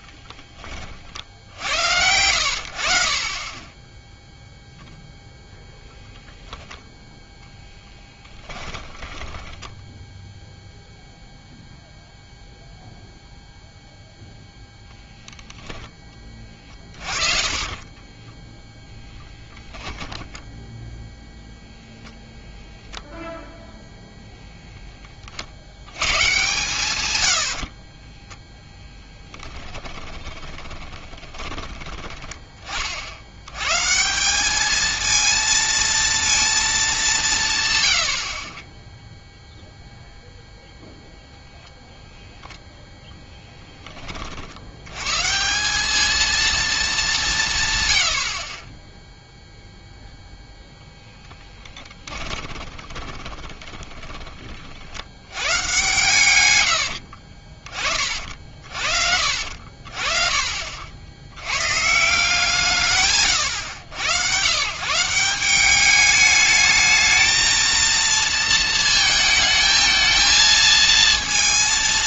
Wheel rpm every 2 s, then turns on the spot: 20, 60, 0, 0, 10, 0, 0, 0, 30, 10, 10, 0, 0, 140, 20, 20, 20, 210, 210, 30, 0, 0, 90, 220, 20, 0, 20, 40, 100, 50, 50, 160, 130, 210, 230, 220.
8-10 16-22 28-32 52-54